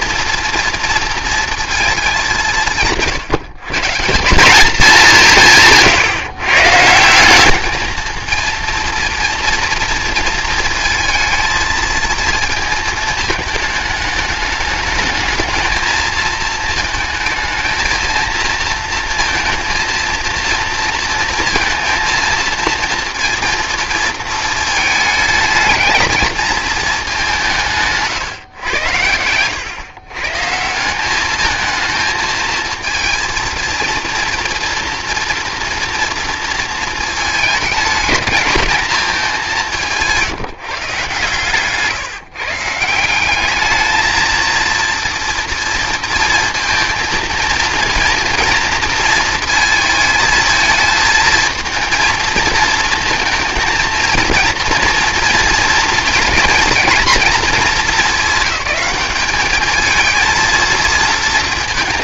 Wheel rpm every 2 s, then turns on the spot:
230, 160, 200, 160, 230, 220, 220, 210, 220, 230, 230, 230, 220, 210, 110, 180, 220, 230, 220, 210, 150, 170, 230, 230, 230, 220, 230, 230, 230, 200, 230.
none